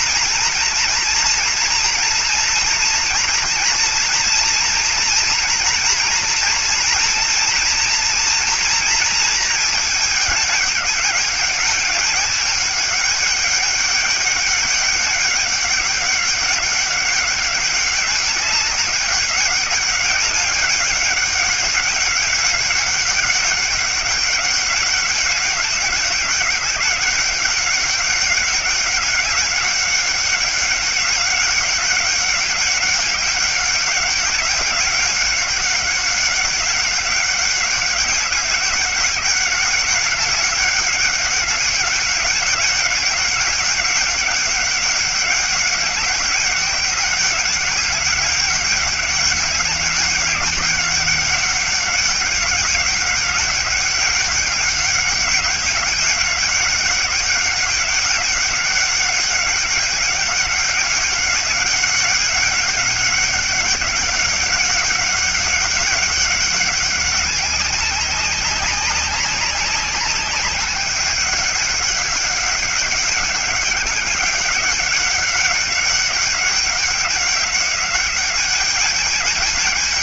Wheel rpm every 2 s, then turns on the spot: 230, 230, 230, 230, 230, 210, 200, 200, 190, 200, 200, 190, 190, 200, 200, 200, 190, 200, 190, 190, 200, 200, 190, 190, 190, 200, 190, 200, 190, 200, 200, 200, 200, 200, 200, 200, 200, 200, 190, 200.
none